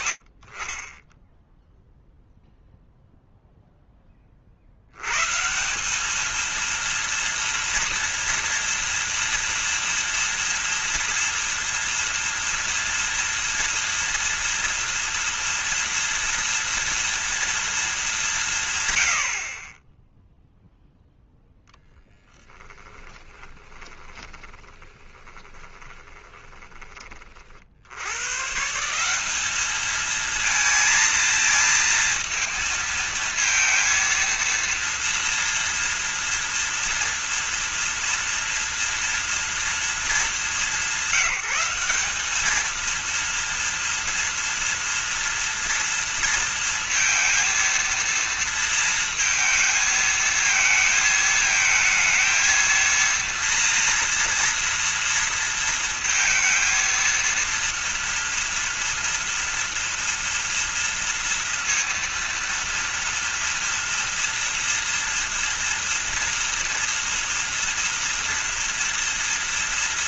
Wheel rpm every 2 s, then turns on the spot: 30, 0, 80, 230, 230, 230, 230, 230, 230, 140, 0, 20, 20, 30, 180, 230, 230, 230, 230, 240, 170, 230, 230, 230, 230, 220, 230, 230, 230, 230, 230, 230, 230, 230, 230.
22-26